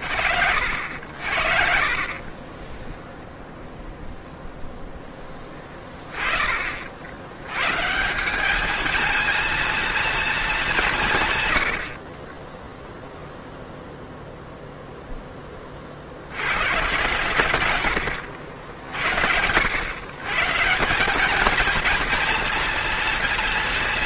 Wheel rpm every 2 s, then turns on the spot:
60, 0, 0, 40, 210, 200, 10, 0, 110, 80, 190, 230.
none